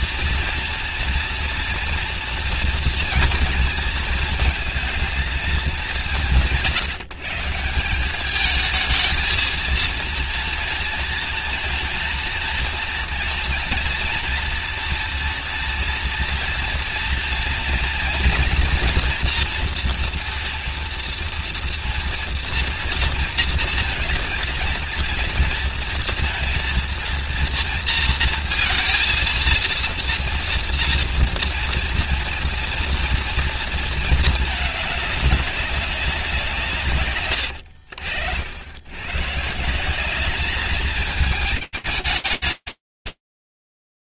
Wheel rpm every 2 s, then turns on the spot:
230, 230, 230, 140, 220, 230, 230, 230, 230, 230, 230, 230, 230, 230, 230, 230, 240, 210, 160, 80, 210, 210.
none